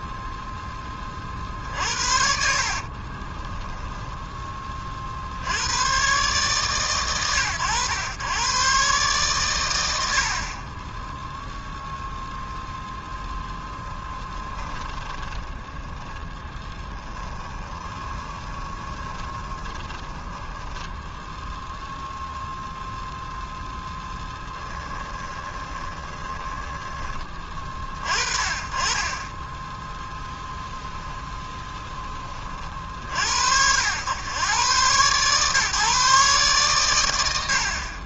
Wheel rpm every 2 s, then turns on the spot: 0, 50, 20, 130, 120, 50, 0, 10, 20, 20, 10, 0, 10, 10, 40, 0, 30, 110, 140.
2-4 14-22 24-28